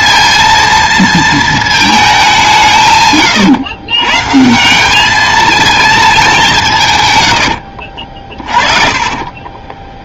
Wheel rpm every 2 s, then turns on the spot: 230, 150, 190, 150, 40.
8-10